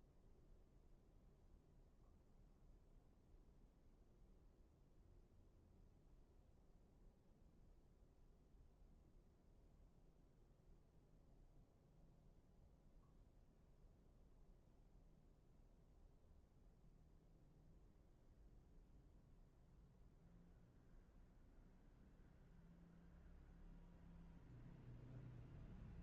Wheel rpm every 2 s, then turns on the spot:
0, 0, 0, 0, 0, 0, 0, 0, 0, 0, 0, 0, 0.
none